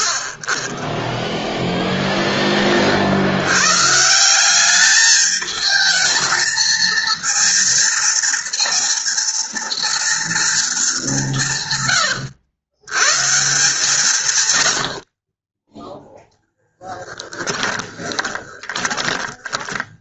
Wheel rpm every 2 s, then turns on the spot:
10, 30, 200, 230, 230, 210, 120, 60, 10, 20.
18-20